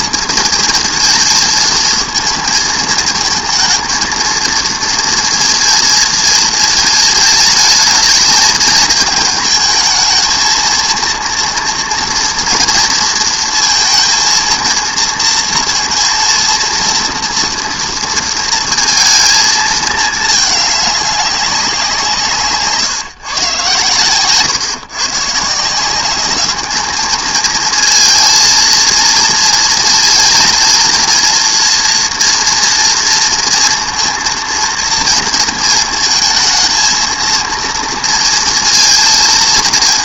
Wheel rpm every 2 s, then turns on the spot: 230, 220, 230, 220, 220, 230, 230, 230, 230, 230, 210, 150, 120, 210, 230, 230, 230, 230, 220, 230.
none